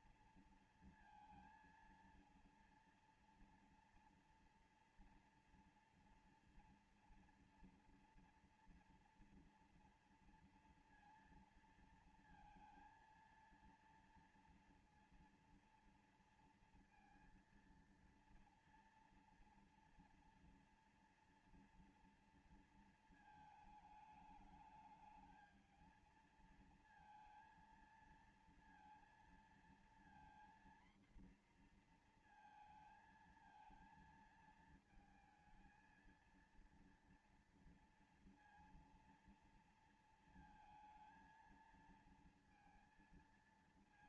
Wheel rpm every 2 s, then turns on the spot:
230, 230, 230, 240, 230, 230, 230, 230, 230, 230, 240, 230, 210, 230, 230, 240, 230, 230, 230, 230, 230, 230.
none